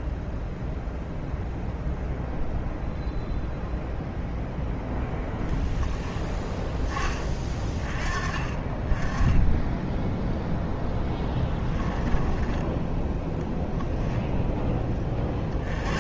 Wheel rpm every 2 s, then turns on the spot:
0, 0, 0, 10, 20, 0, 10, 10.
none